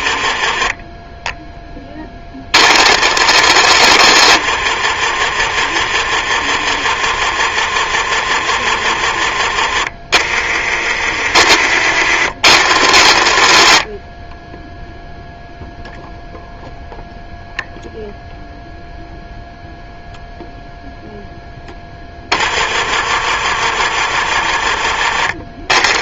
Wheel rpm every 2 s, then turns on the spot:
10, 40, 30, 30, 30, 30, 70, 0, 0, 0, 0, 30, 30.
2-6